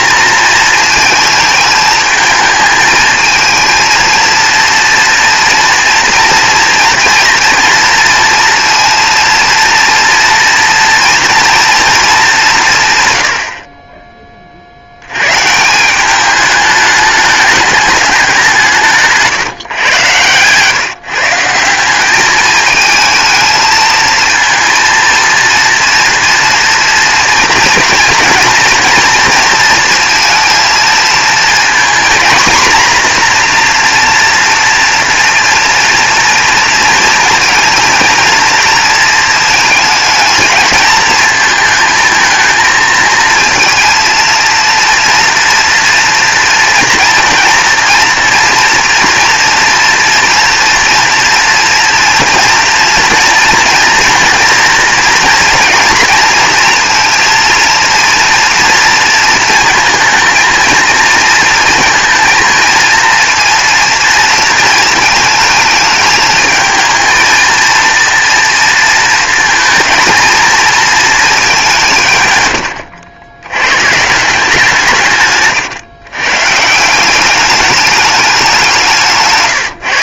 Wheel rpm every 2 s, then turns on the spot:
230, 220, 230, 230, 230, 230, 140, 90, 210, 160, 150, 220, 230, 230, 230, 230, 240, 230, 230, 230, 230, 220, 240, 230, 230, 230, 230, 230, 230, 230, 230, 230, 220, 220, 230, 220, 80, 160, 170, 180.
none